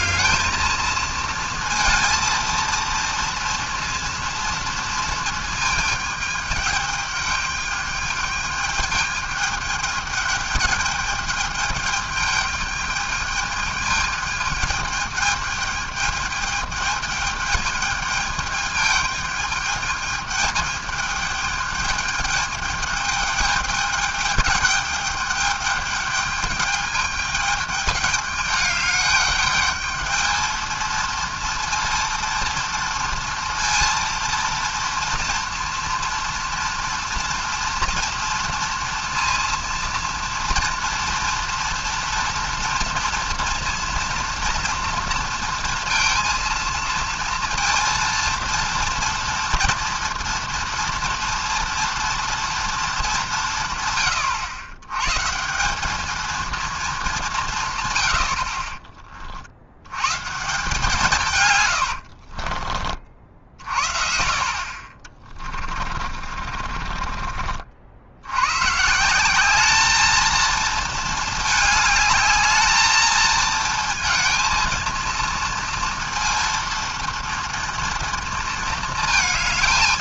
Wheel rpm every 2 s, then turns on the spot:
220, 230, 230, 210, 210, 210, 210, 210, 210, 210, 210, 210, 210, 210, 210, 220, 230, 230, 230, 230, 230, 230, 230, 230, 230, 230, 230, 110, 230, 50, 160, 40, 50, 30, 120, 220, 210, 230, 230, 230.
62-64 66-68